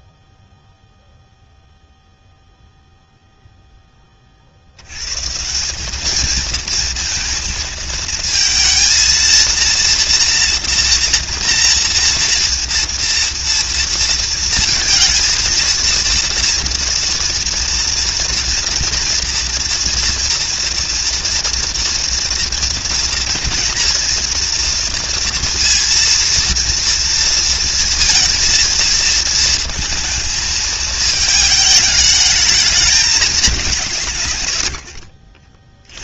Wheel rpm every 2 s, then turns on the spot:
0, 0, 10, 190, 230, 230, 230, 230, 230, 230, 230, 230, 230, 230, 230, 230, 210, 160.
none